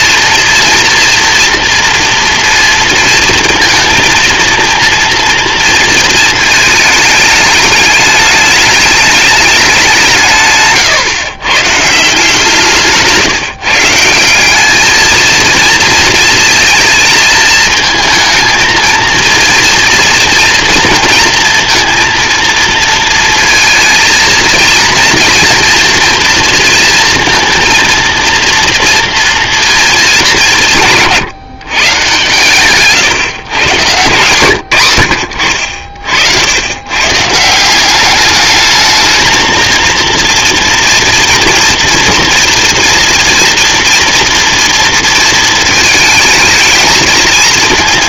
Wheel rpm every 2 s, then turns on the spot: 230, 230, 230, 220, 210, 140, 160, 210, 220, 220, 230, 230, 230, 230, 230, 160, 130, 110, 100, 210, 240, 230, 230, 220.
32-34